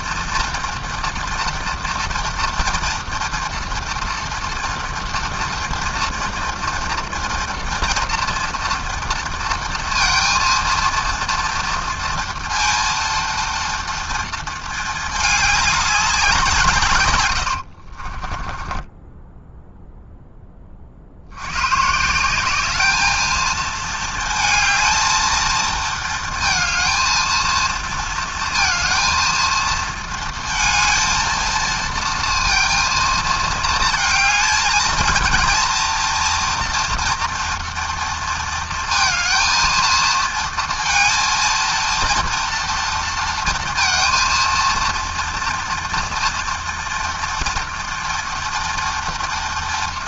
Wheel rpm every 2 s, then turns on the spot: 230, 240, 230, 230, 230, 230, 230, 210, 100, 10, 80, 220, 220, 220, 230, 230, 230, 230, 230, 230, 230, 230, 230, 230, 230.
16-20